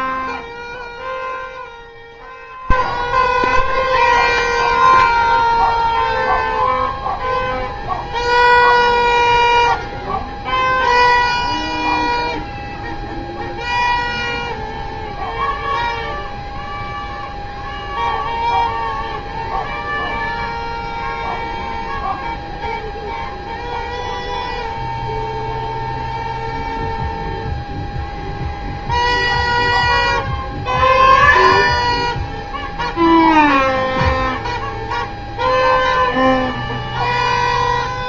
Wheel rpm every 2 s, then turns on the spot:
0, 0, 0, 0, 0, 0, 0, 0, 0, 0, 0, 0, 0, 0, 0, 0, 0, 0, 0.
none